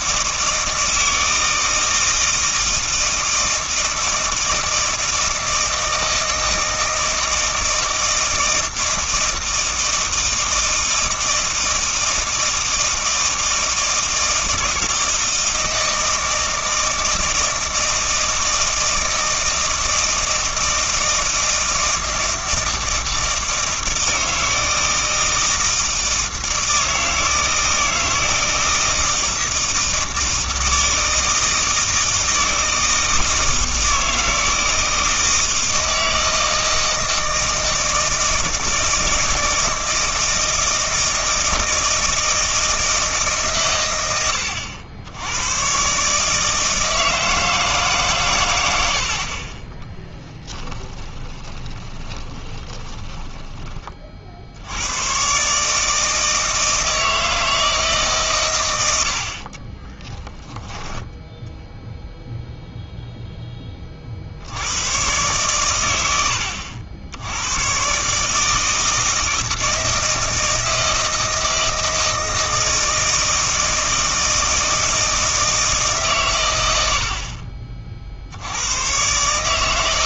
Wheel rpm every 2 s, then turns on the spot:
160, 160, 160, 160, 160, 160, 160, 160, 160, 160, 160, 160, 160, 160, 160, 160, 160, 160, 160, 160, 170, 160, 90, 160, 80, 20, 20, 90, 160, 90, 10, 0, 110, 80, 160, 160, 160, 160, 90, 110.
48-54 58-60